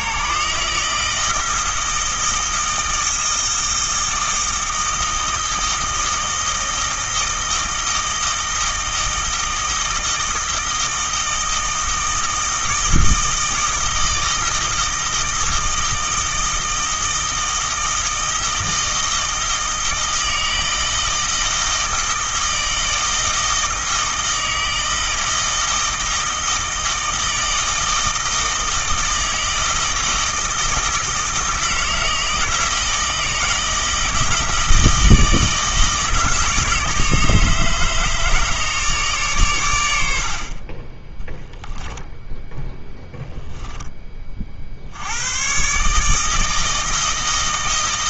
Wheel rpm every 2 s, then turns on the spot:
160, 160, 160, 160, 160, 160, 160, 160, 160, 160, 160, 160, 160, 160, 160, 160, 160, 160, 160, 150, 20, 10, 80, 160.
none